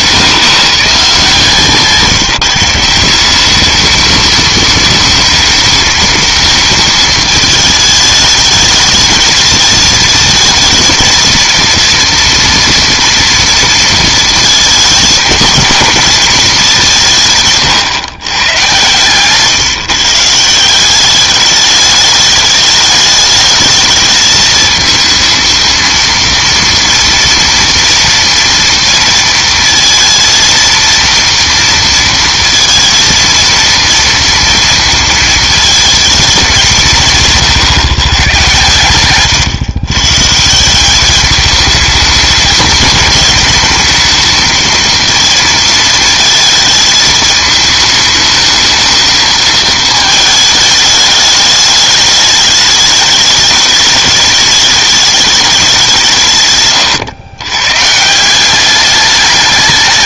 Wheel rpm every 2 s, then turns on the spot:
160, 170, 220, 220, 210, 220, 230, 230, 210, 120, 170, 210, 220, 230, 230, 230, 230, 230, 180, 120, 170, 210, 220, 220, 220, 220, 210, 210, 120, 190.
18-20